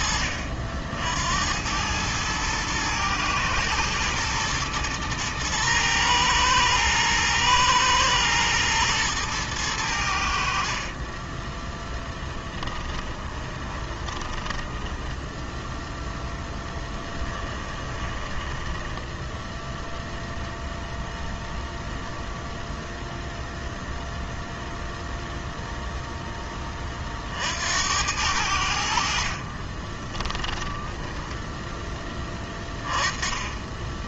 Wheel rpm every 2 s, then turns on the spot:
70, 110, 110, 110, 110, 30, 20, 10, 10, 10, 0, 0, 0, 40, 60, 10, 20.
10-20